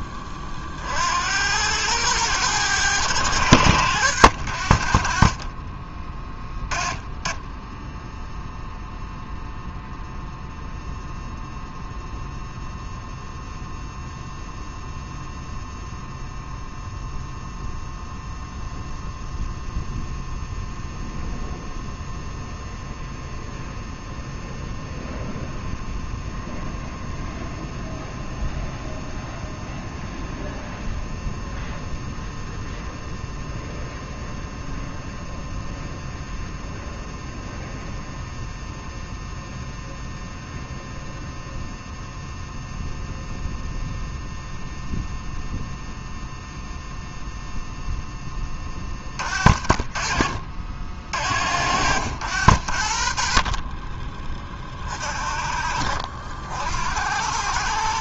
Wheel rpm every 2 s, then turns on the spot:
40, 100, 80, 20, 0, 0, 0, 0, 0, 0, 0, 0, 0, 0, 0, 0, 0, 0, 0, 0, 0, 0, 0, 0, 20, 40, 70, 30, 70.
none